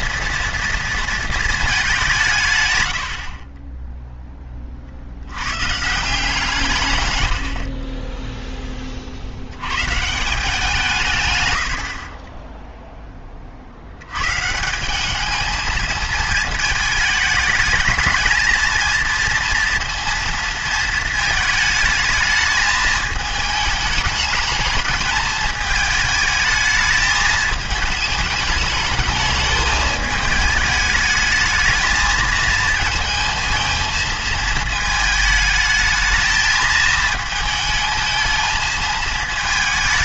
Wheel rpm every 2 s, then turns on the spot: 230, 140, 20, 150, 10, 170, 10, 170, 220, 220, 230, 220, 210, 220, 210, 210, 230, 220, 220, 220.
none